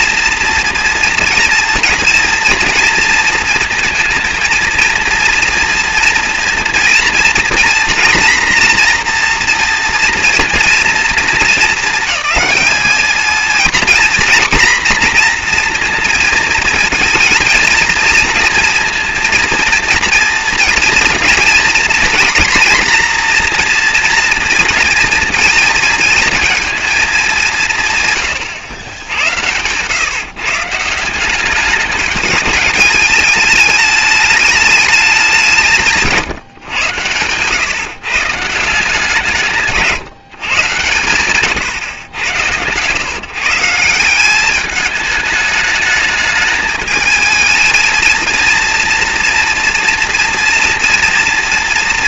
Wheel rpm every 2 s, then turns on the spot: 240, 230, 230, 230, 240, 230, 220, 240, 230, 230, 230, 240, 240, 220, 90, 150, 210, 210, 120, 170, 130, 110, 210, 210, 230, 240.
none